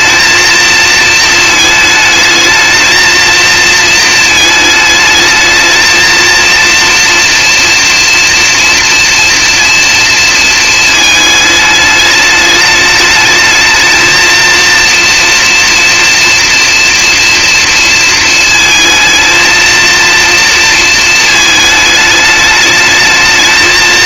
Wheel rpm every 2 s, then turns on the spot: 220, 220, 220, 230, 230, 220, 210, 230, 230, 230, 230, 210.
none